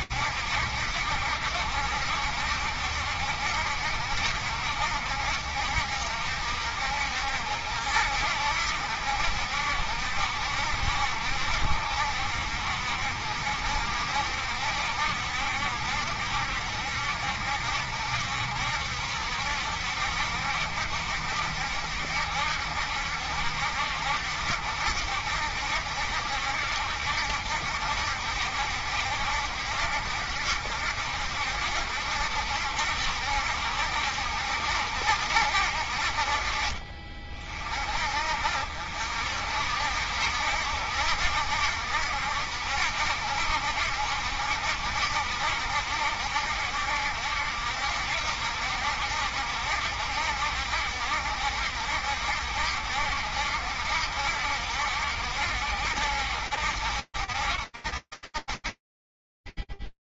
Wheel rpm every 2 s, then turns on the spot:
70, 70, 60, 60, 70, 60, 60, 70, 70, 70, 70, 70, 70, 70, 70, 70, 70, 50, 50, 70, 70, 70, 70, 70, 70, 70, 70, 70, 70, 10.
none